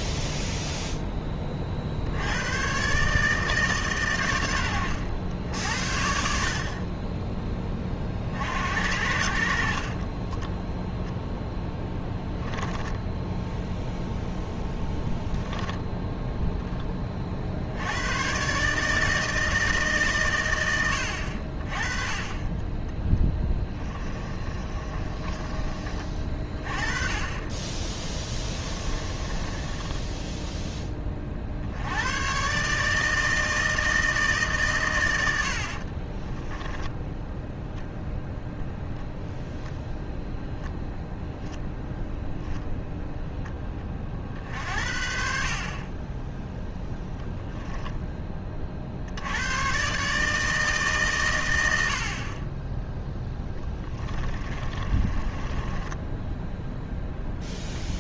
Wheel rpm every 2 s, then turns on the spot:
10, 130, 90, 30, 60, 0, 10, 10, 20, 150, 90, 20, 30, 30, 20, 20, 150, 120, 10, 0, 0, 0, 50, 0, 40, 140, 10, 30, 0.
12-14 24-26 28-30 54-56